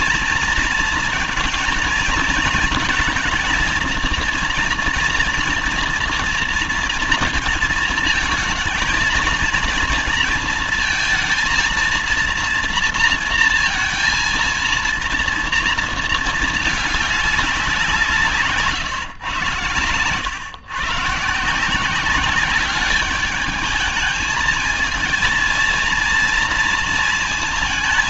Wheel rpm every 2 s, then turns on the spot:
230, 230, 230, 230, 220, 230, 230, 230, 220, 140, 130, 200, 220, 230.
none